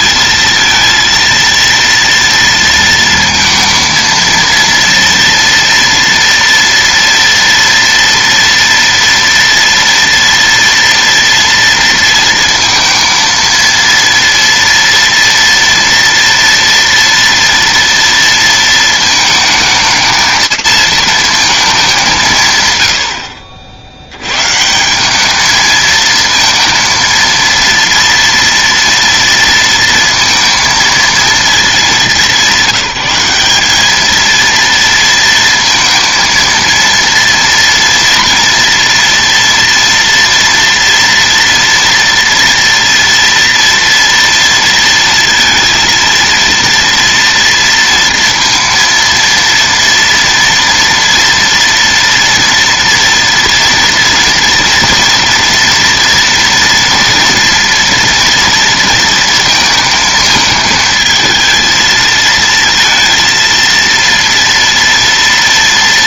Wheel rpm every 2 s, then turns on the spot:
230, 230, 230, 230, 230, 230, 230, 230, 230, 230, 220, 140, 140, 230, 230, 230, 170, 230, 230, 230, 240, 230, 230, 230, 230, 240, 230, 230, 230, 230, 220, 220, 230.
none